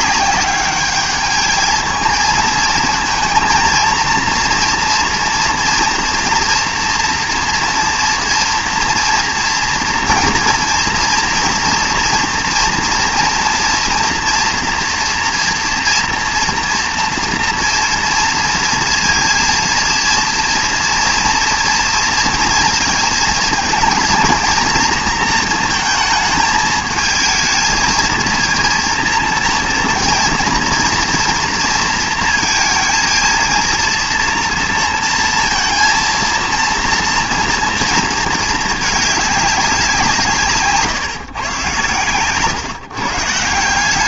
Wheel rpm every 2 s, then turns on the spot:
200, 220, 230, 230, 230, 230, 230, 230, 230, 230, 230, 230, 230, 210, 230, 230, 230, 230, 230, 220, 140, 130.
none